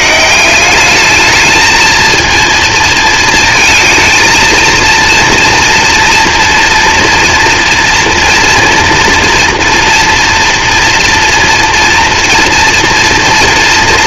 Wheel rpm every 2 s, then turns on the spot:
190, 230, 230, 230, 230, 230, 230.
none